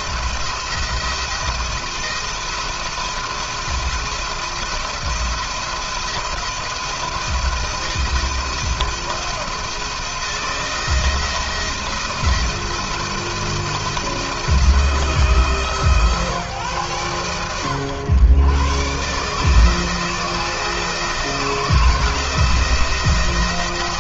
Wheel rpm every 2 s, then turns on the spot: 170, 170, 160, 170, 170, 170, 170, 160, 130, 120, 160, 170.
none